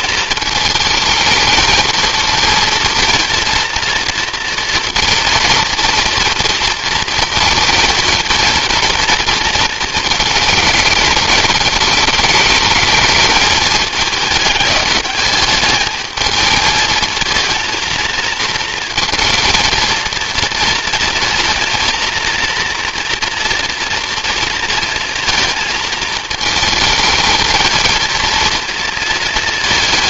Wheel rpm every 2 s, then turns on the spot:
220, 230, 230, 230, 230, 220, 220, 210, 220, 220, 230, 230, 230, 220, 230.
none